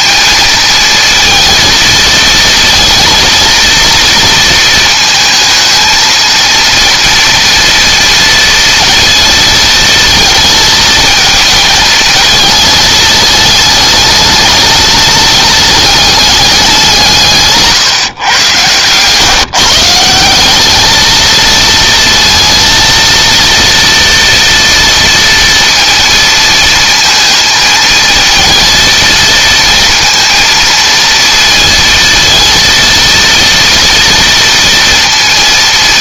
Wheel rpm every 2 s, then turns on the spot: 220, 230, 230, 230, 230, 230, 220, 210, 180, 120, 210, 230, 230, 230, 230, 230, 230, 230.
18-20